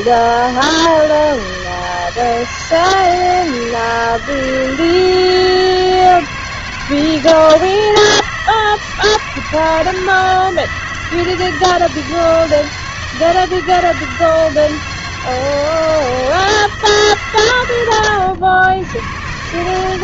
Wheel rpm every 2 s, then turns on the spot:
160, 160, 160, 160, 160, 160, 160, 160, 160, 100.
none